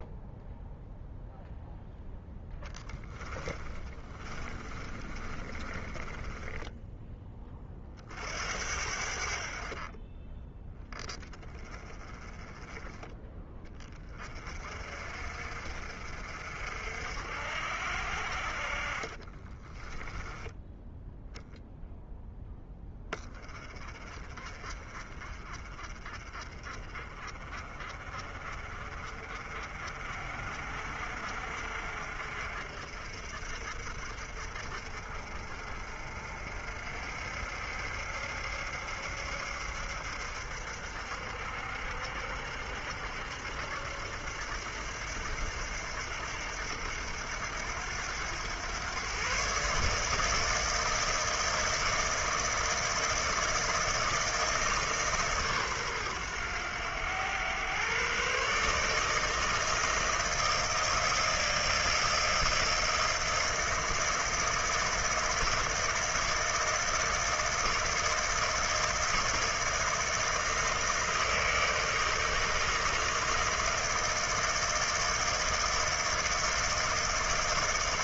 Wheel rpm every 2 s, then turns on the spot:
0, 10, 30, 10, 60, 10, 20, 40, 60, 30, 0, 20, 30, 30, 30, 50, 50, 50, 60, 70, 70, 70, 80, 80, 120, 160, 160, 140, 100, 160, 160, 160, 160, 160, 160, 160, 160, 160, 160.
2-6 18-20